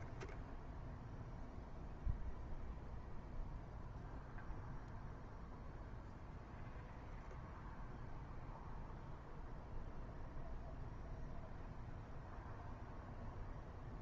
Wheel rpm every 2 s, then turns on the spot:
0, 0, 0, 0, 0, 0, 0.
none